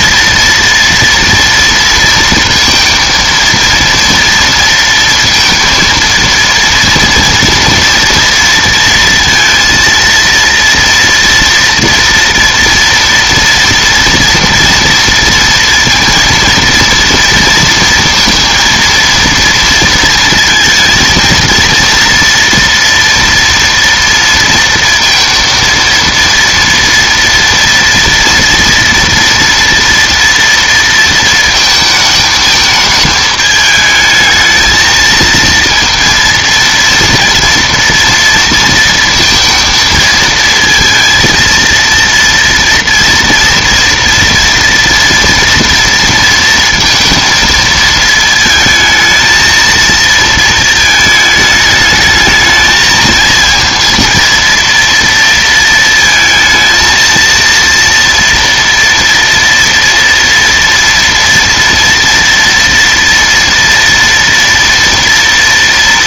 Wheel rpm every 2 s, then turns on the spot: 230, 230, 230, 230, 230, 230, 230, 230, 230, 230, 230, 230, 230, 230, 230, 230, 220, 220, 230, 230, 230, 230, 230, 230, 230, 220, 220, 230, 230, 230, 230, 240, 230.
none